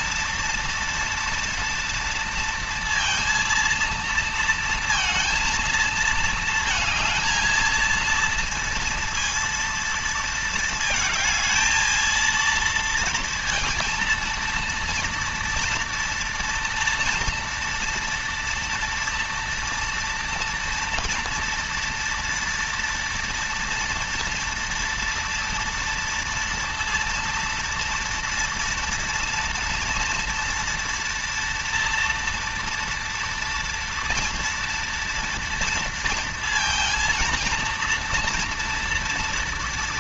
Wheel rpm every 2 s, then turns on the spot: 230, 230, 230, 230, 230, 220, 230, 230, 230, 230, 230, 230, 230, 230, 230, 240, 230, 230, 230, 230.
none